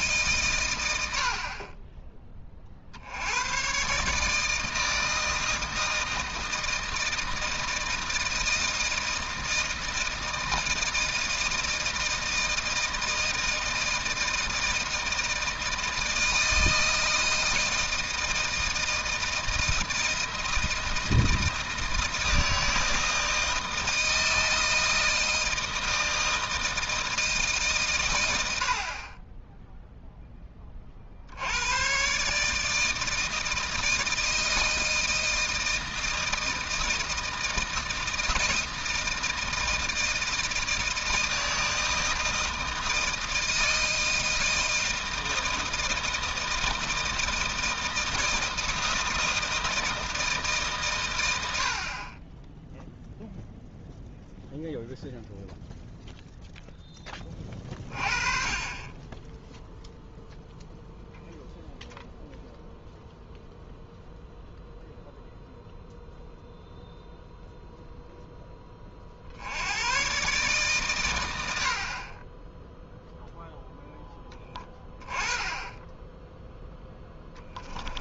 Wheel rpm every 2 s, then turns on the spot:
110, 50, 160, 160, 160, 160, 160, 160, 160, 160, 160, 160, 160, 160, 50, 30, 150, 160, 160, 160, 160, 160, 160, 160, 160, 140, 0, 0, 10, 20, 0, 0, 0, 0, 20, 130, 0, 10, 0.
none